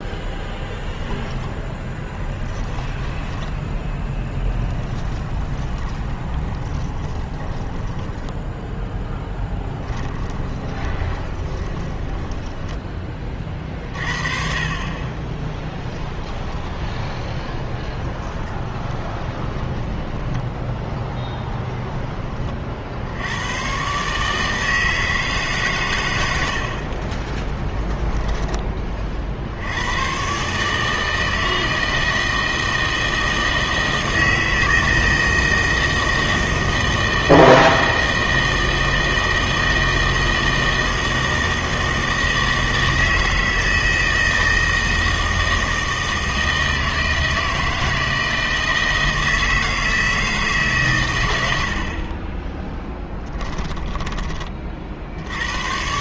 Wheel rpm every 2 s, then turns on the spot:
20, 10, 10, 20, 10, 20, 10, 30, 20, 20, 10, 40, 160, 70, 20, 140, 160, 160, 160, 160, 160, 160, 160, 160, 160, 140, 10, 30.
2-8 10-14 16-20